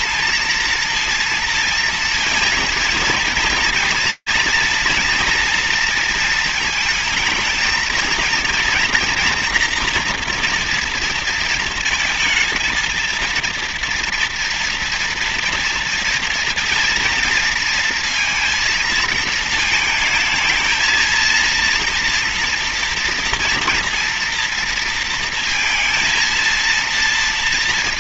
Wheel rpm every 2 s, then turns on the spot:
230, 230, 230, 220, 230, 230, 230, 230, 230, 230, 220, 230, 230, 230.
none